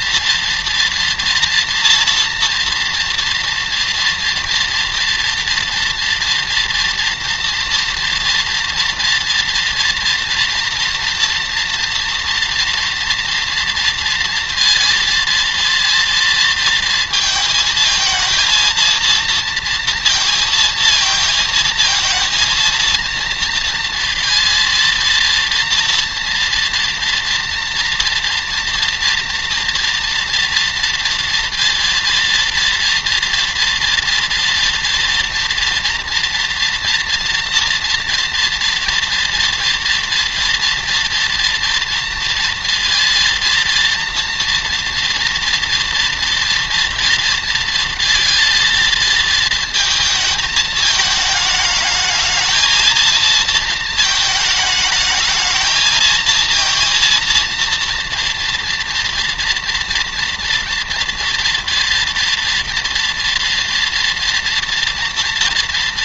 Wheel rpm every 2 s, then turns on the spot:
230, 230, 240, 230, 230, 230, 230, 230, 220, 230, 230, 220, 230, 230, 230, 230, 240, 230, 240, 230, 230, 230, 230, 230, 230, 220, 220, 220, 230, 240, 230, 230, 230.
none